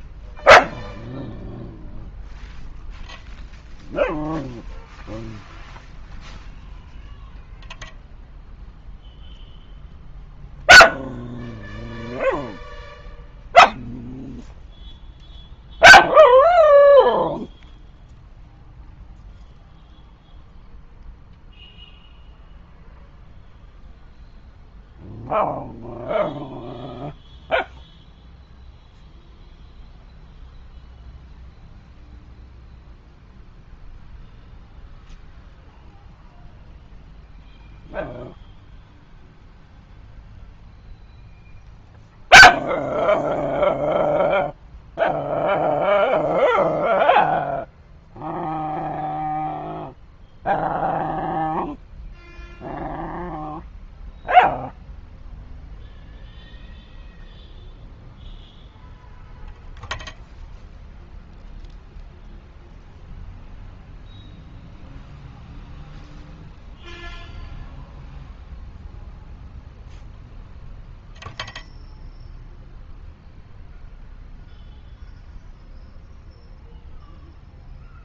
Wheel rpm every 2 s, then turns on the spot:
0, 0, 0, 0, 0, 0, 0, 0, 0, 0, 0, 0, 0, 0, 0, 0, 0, 0, 0, 0, 0, 0, 0, 0, 0, 0, 0, 0, 0, 0, 0, 0, 0, 0, 0, 0, 0, 0, 0.
none